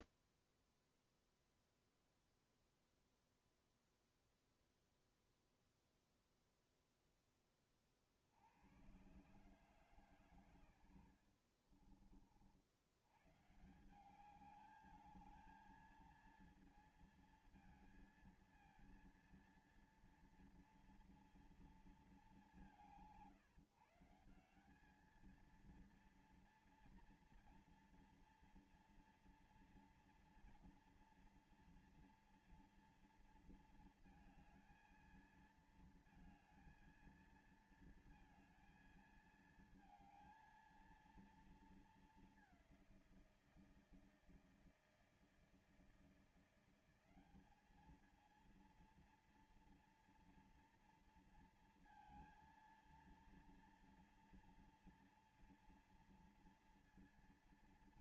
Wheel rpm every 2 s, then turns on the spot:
0, 0, 0, 0, 50, 130, 50, 170, 220, 230, 230, 200, 160, 230, 230, 230, 230, 220, 220, 230, 220, 210, 160, 170, 210, 230, 230, 230, 230.
none